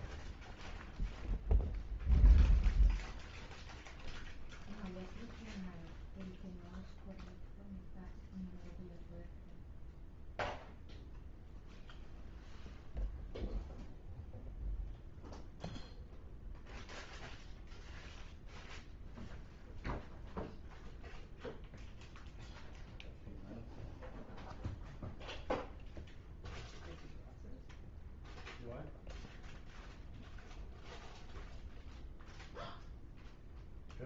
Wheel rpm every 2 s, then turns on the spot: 0, 0, 0, 0, 0, 0, 0, 0, 0, 0, 0, 0, 0, 0, 0, 0, 0.
none